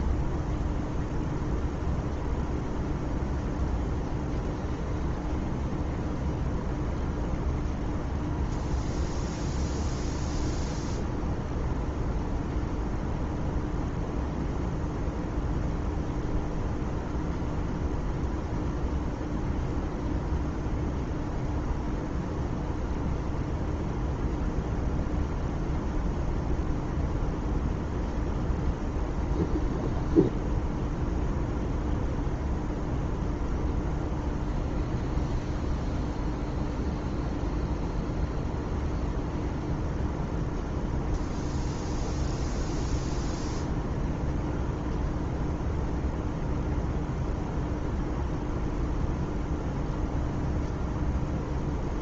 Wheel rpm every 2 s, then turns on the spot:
0, 0, 0, 0, 0, 0, 0, 0, 0, 0, 0, 0, 0, 0, 0, 0, 0, 0, 0, 0, 0, 0, 0, 0, 0, 0.
none